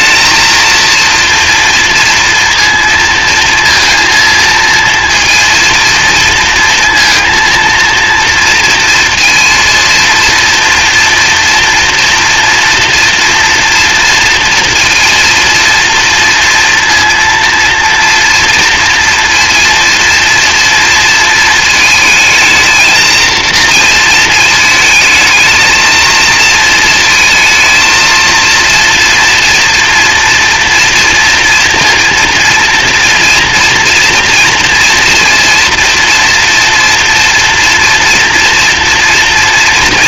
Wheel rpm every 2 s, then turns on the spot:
230, 230, 230, 230, 230, 230, 230, 230, 230, 230, 230, 220, 220, 230, 240, 230, 240, 230, 230, 230.
none